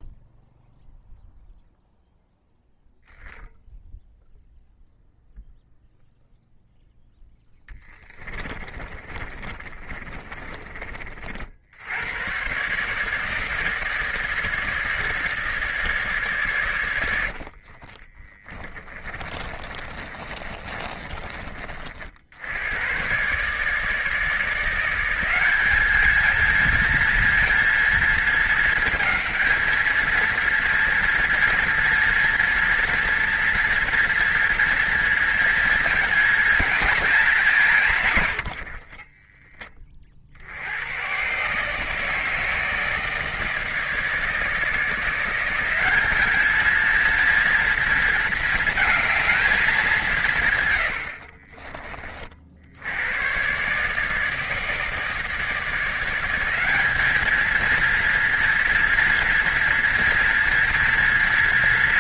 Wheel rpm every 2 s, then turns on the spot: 0, 0, 0, 0, 20, 30, 130, 160, 120, 20, 30, 90, 170, 220, 220, 230, 240, 230, 230, 110, 80, 160, 160, 220, 220, 120, 60, 160, 200, 230, 240.
8-10 18-22 38-40